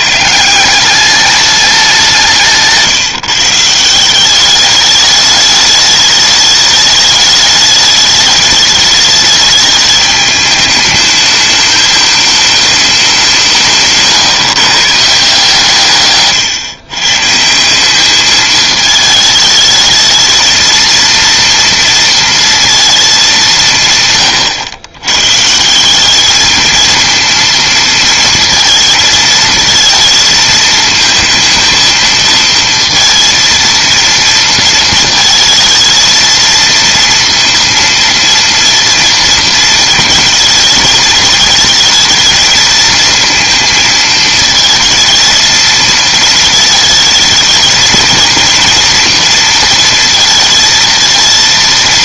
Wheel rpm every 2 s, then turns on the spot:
160, 170, 200, 210, 210, 210, 210, 140, 140, 210, 220, 230, 120, 220, 230, 220, 230, 230, 230, 230, 220, 220, 220, 220, 230, 230.
none